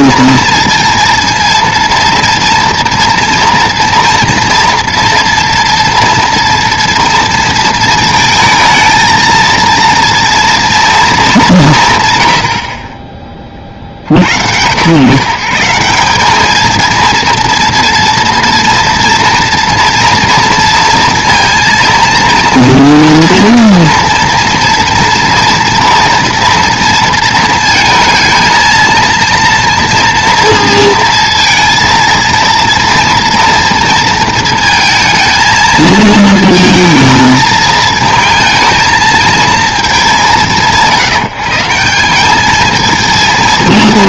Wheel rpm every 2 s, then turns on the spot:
230, 230, 230, 230, 220, 230, 70, 100, 220, 230, 230, 230, 230, 230, 230, 230, 230, 230, 230, 220, 170, 220.
none